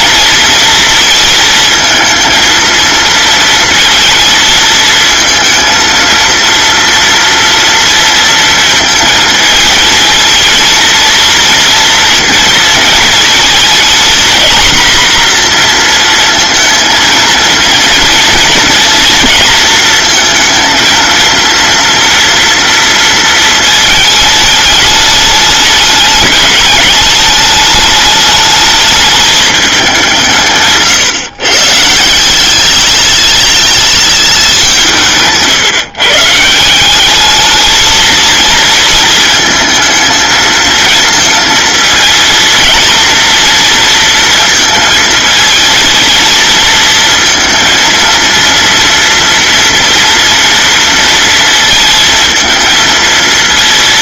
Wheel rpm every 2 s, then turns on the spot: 230, 230, 220, 230, 220, 230, 230, 240, 230, 230, 230, 230, 210, 200, 210, 130, 200, 180, 180, 220, 230, 230, 220, 230, 230, 230, 230.
none